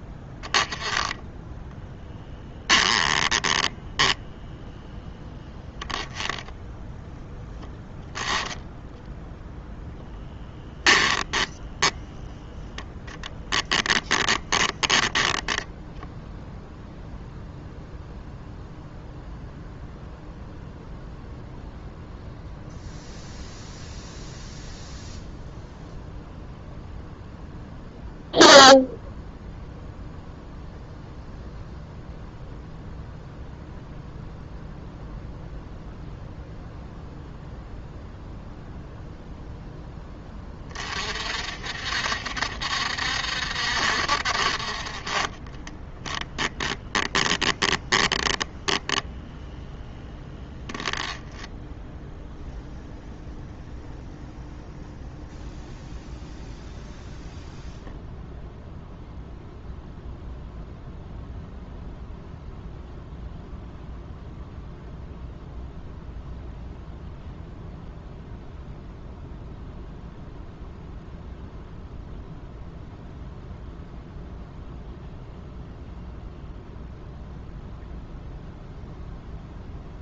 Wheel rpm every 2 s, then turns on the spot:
10, 10, 10, 10, 10, 10, 10, 10, 0, 0, 0, 0, 0, 0, 0, 0, 0, 0, 0, 0, 40, 60, 30, 10, 10, 10, 10, 10, 0, 0, 0, 0, 0, 0, 0, 0, 0, 0, 0, 0.
2-4 10-12 14-16 44-50